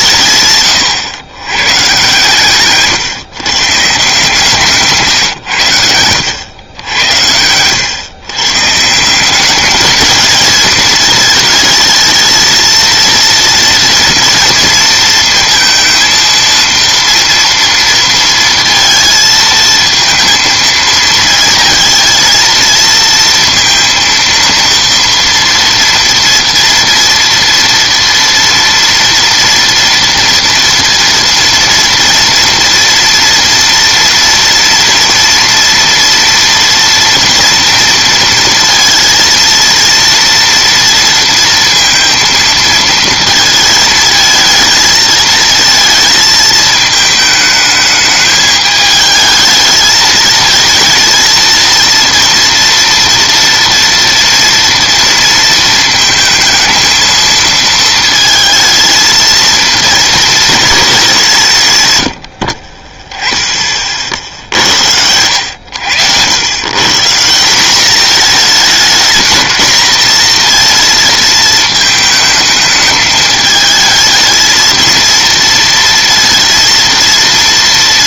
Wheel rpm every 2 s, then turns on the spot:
130, 130, 150, 90, 140, 220, 220, 230, 230, 230, 220, 230, 230, 230, 230, 230, 230, 230, 230, 230, 230, 230, 220, 220, 210, 220, 230, 230, 230, 220, 210, 30, 70, 120, 220, 230, 220, 220, 230.
4-6